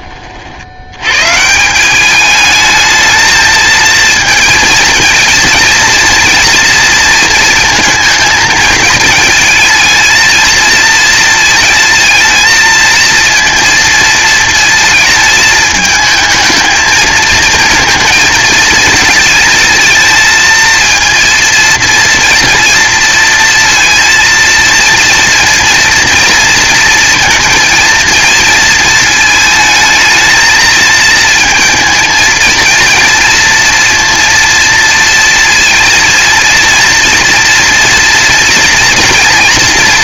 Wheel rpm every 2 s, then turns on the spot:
90, 220, 230, 230, 220, 230, 230, 220, 220, 220, 230, 230, 230, 230, 230, 230, 230, 230, 230, 230.
none